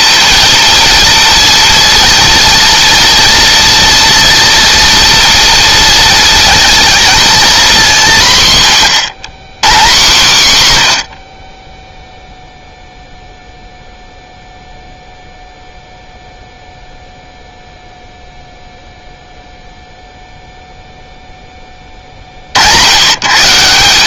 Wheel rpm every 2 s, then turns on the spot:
230, 230, 230, 230, 130, 100, 0, 0, 0, 0, 0, 110.
10-12